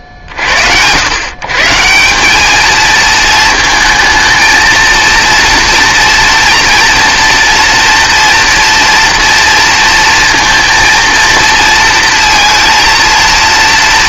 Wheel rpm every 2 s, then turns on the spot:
50, 210, 230, 230, 230, 230, 230.
none